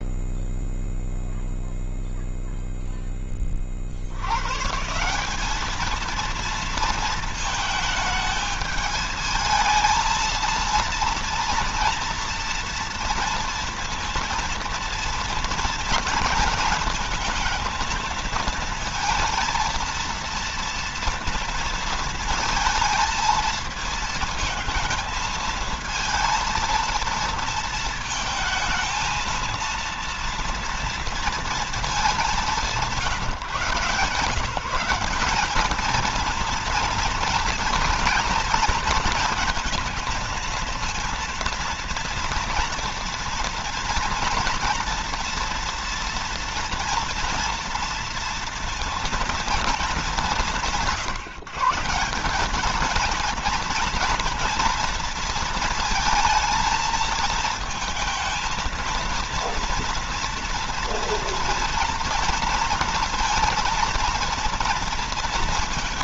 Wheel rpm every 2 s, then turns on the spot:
0, 10, 170, 220, 220, 230, 230, 230, 230, 230, 230, 230, 220, 230, 220, 230, 180, 200, 230, 230, 230, 230, 230, 230, 230, 160, 220, 230, 230, 230, 230, 230, 230.
none